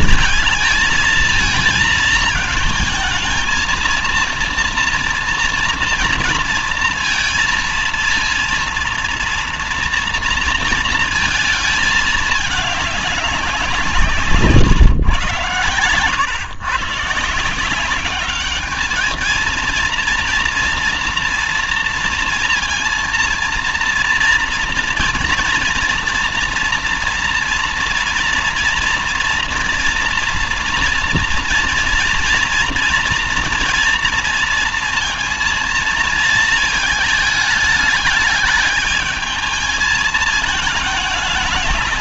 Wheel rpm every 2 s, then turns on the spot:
220, 220, 230, 230, 230, 230, 210, 140, 120, 210, 230, 230, 230, 230, 230, 230, 230, 230, 220, 210, 220.
none